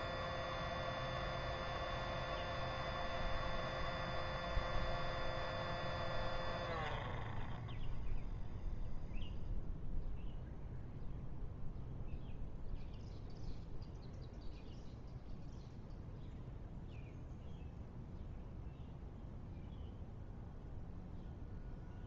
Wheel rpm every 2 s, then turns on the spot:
0, 0, 0, 0, 0, 0, 0, 0, 0, 0, 0.
none